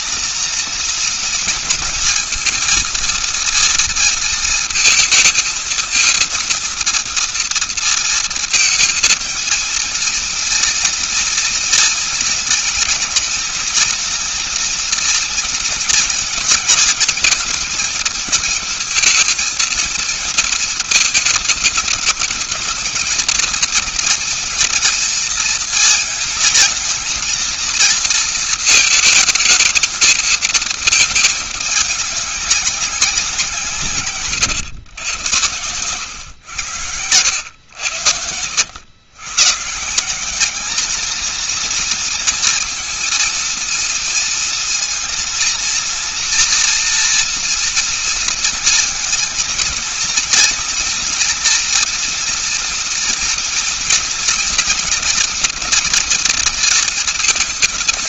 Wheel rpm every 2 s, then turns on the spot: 230, 230, 230, 230, 230, 230, 220, 230, 230, 220, 220, 220, 230, 220, 230, 220, 200, 120, 110, 90, 200, 230, 230, 230, 230, 230, 230, 230, 230.
none